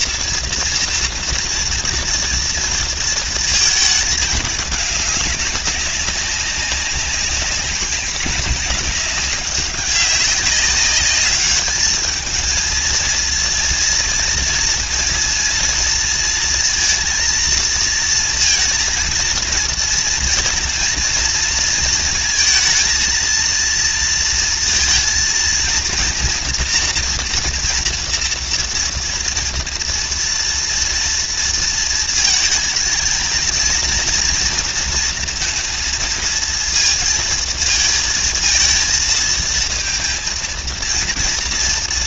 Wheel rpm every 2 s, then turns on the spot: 230, 230, 210, 190, 200, 200, 230, 230, 230, 230, 230, 230, 230, 230, 230, 230, 230, 230, 230, 230, 230.
none